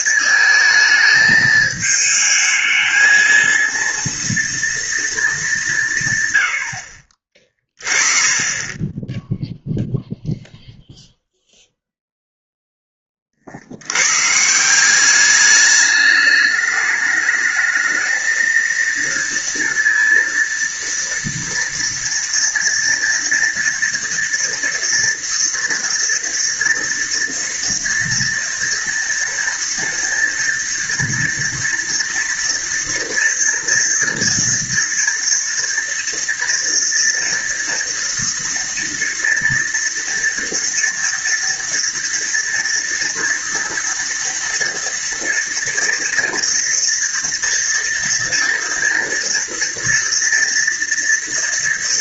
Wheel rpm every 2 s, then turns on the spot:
220, 220, 230, 80, 20, 0, 0, 160, 210, 230, 230, 230, 230, 230, 230, 230, 230, 230, 230, 230, 230, 230, 230, 230, 230, 230.
8-10